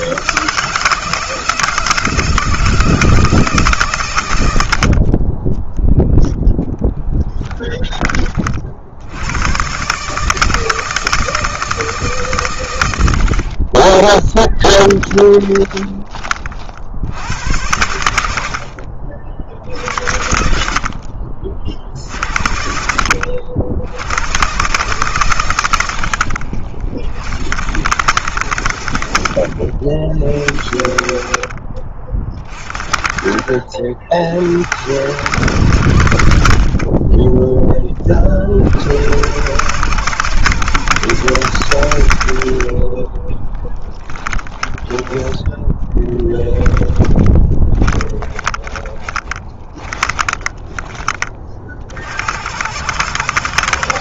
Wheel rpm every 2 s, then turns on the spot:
160, 160, 40, 10, 80, 160, 100, 20, 80, 60, 60, 70, 120, 60, 80, 50, 40, 90, 30, 70, 110, 20, 10, 10, 20, 30, 100.
6-8 14-16 42-50